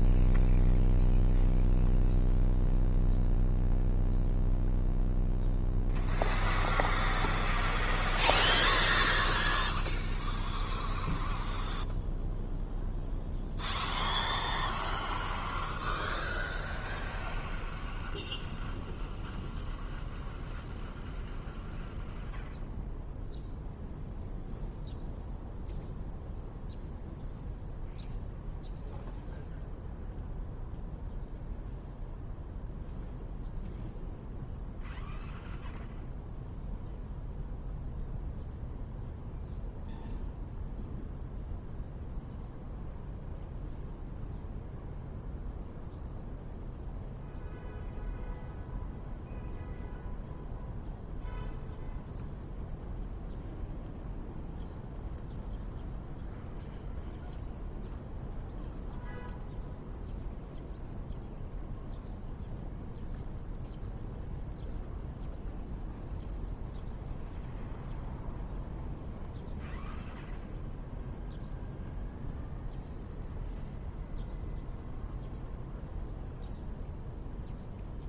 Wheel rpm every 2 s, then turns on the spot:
0, 0, 0, 0, 0, 0, 0, 0, 0, 0, 0, 0, 0, 0, 0, 0, 0, 0, 0, 0, 0, 0, 0, 0, 0, 0, 0, 0, 0, 0, 0, 0, 0, 0, 0, 0, 0, 0, 0.
none